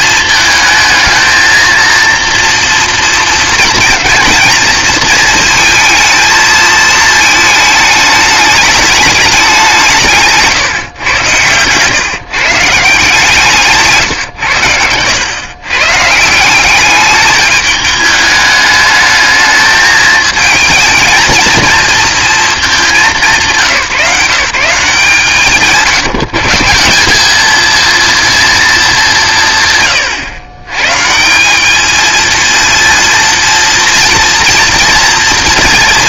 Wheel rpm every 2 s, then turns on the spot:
220, 230, 230, 220, 210, 140, 150, 100, 190, 210, 230, 220, 170, 160, 220, 120, 230, 240.
none